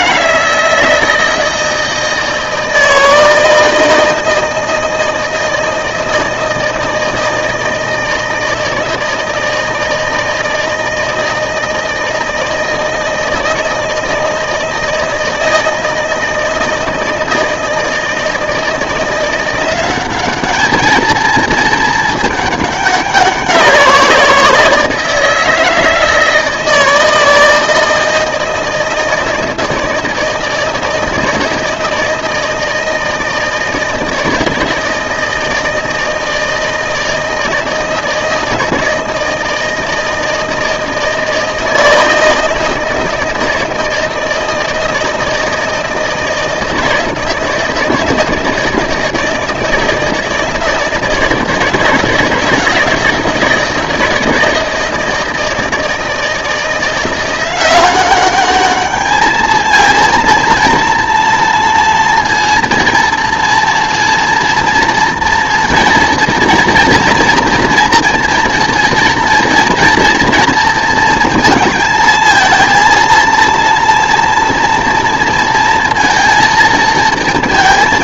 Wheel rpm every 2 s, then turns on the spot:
160, 160, 160, 160, 160, 160, 160, 160, 160, 170, 210, 200, 170, 160, 160, 160, 160, 160, 160, 160, 160, 160, 160, 170, 160, 160, 160, 160, 170, 210, 230, 230, 230, 230, 230, 230, 230, 240, 220.
none